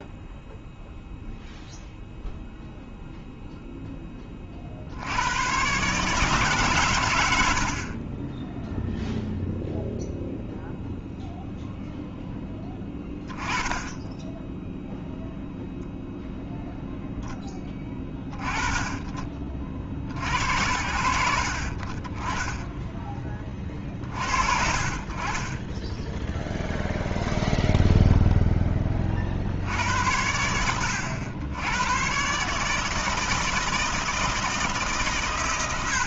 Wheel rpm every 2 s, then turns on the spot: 0, 0, 20, 140, 20, 0, 10, 10, 0, 20, 60, 20, 40, 0, 10, 90, 140, 160.
8-10